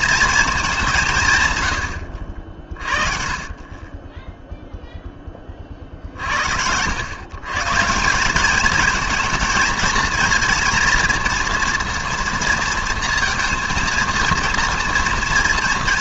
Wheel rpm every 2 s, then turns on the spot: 200, 50, 0, 80, 210, 230, 230, 230.
none